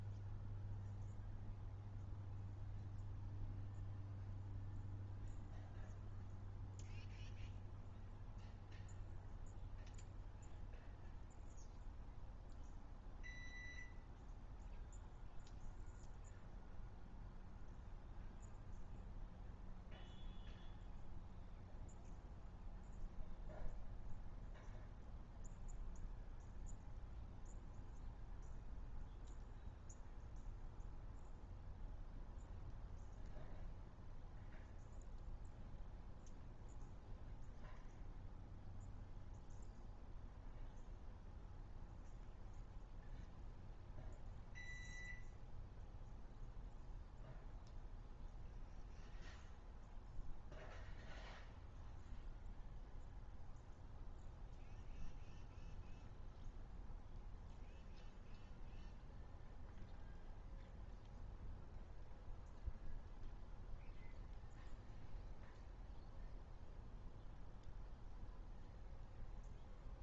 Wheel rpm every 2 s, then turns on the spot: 0, 0, 0, 0, 0, 0, 0, 0, 0, 0, 0, 0, 0, 0, 0, 0, 0, 0, 0, 0, 0, 0, 0, 0, 0, 0, 0, 0, 0, 0, 0, 0, 0, 0, 0.
none